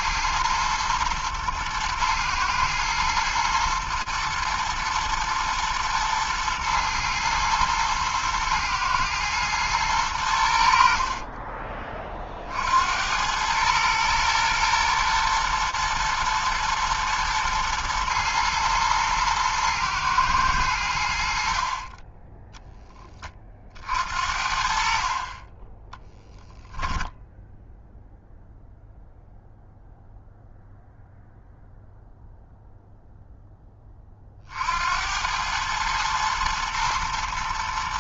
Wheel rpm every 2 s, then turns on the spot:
110, 120, 120, 110, 110, 90, 50, 110, 120, 120, 110, 20, 60, 10, 0, 0, 0, 40, 110.
none